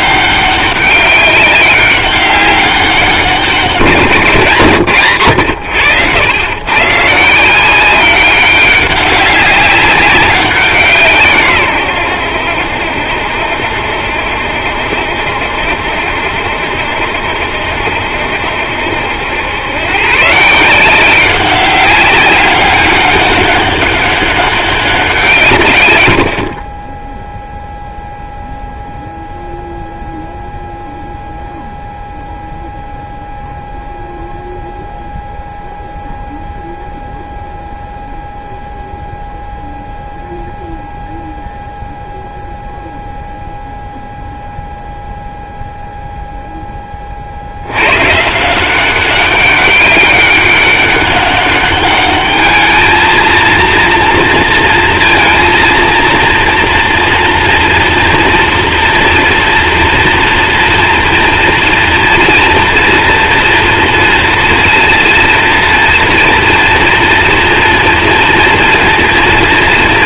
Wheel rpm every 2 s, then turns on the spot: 200, 190, 150, 120, 200, 180, 80, 70, 70, 70, 160, 200, 200, 50, 0, 0, 0, 0, 0, 0, 0, 0, 0, 10, 170, 200, 220, 230, 240, 230, 230, 240, 230, 230, 230.
none